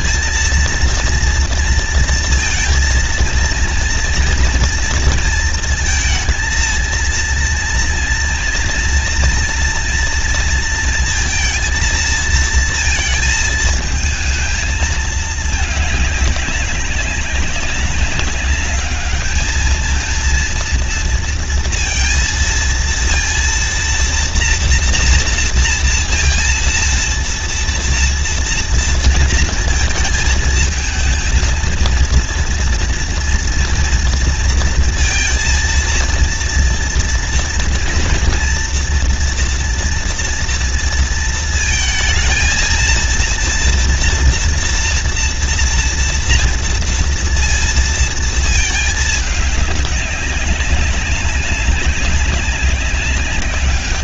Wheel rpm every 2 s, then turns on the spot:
230, 230, 230, 230, 230, 230, 230, 220, 200, 210, 230, 230, 230, 230, 230, 220, 230, 230, 230, 230, 230, 230, 230, 230, 220, 200, 200.
none